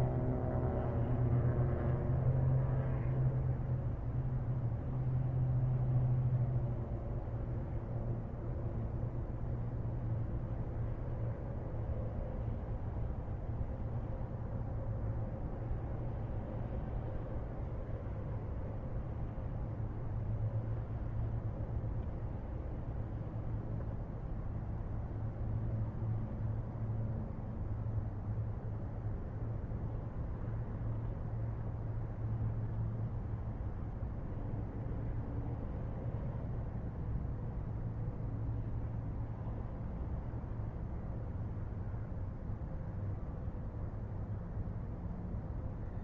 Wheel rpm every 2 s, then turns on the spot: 0, 0, 0, 0, 0, 0, 0, 0, 0, 0, 0, 0, 0, 0, 0, 0, 0, 0, 0, 0, 0, 0, 0.
none